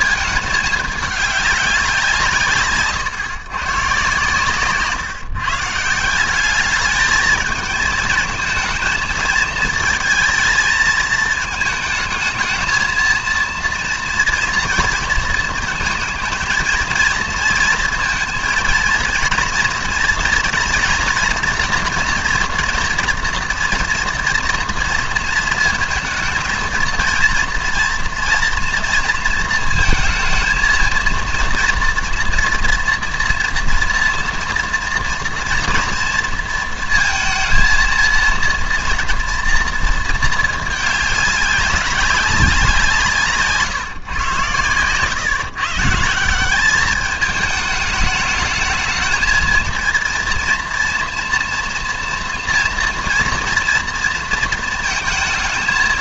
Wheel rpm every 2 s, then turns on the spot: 220, 140, 140, 200, 220, 230, 220, 230, 220, 230, 240, 240, 230, 230, 230, 230, 230, 230, 230, 230, 210, 190, 120, 190, 220, 230, 230, 230.
none